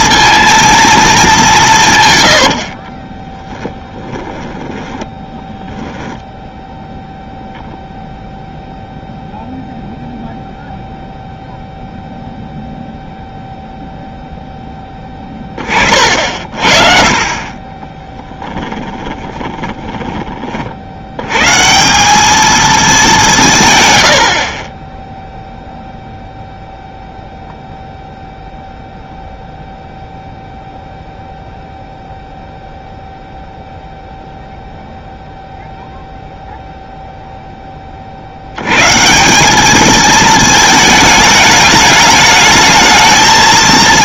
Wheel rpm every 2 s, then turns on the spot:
230, 70, 10, 0, 0, 0, 0, 10, 40, 20, 60, 220, 20, 0, 0, 0, 0, 0, 0, 110, 220, 220.
2-6 14-16 18-20